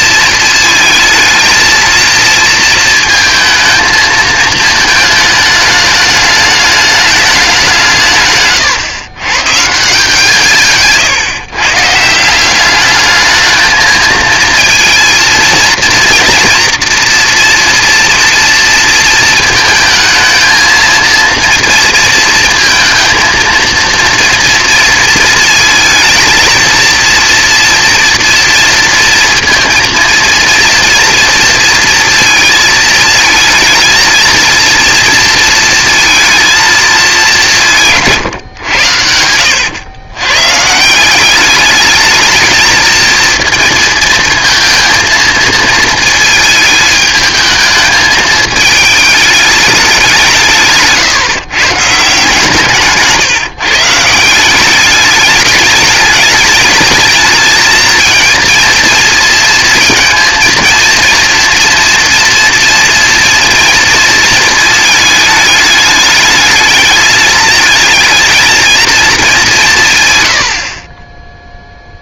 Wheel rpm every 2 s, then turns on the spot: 230, 220, 220, 210, 120, 150, 190, 230, 230, 230, 230, 230, 230, 230, 230, 230, 220, 230, 230, 110, 140, 220, 230, 220, 220, 150, 150, 190, 210, 230, 230, 240, 220, 210, 230, 60.
none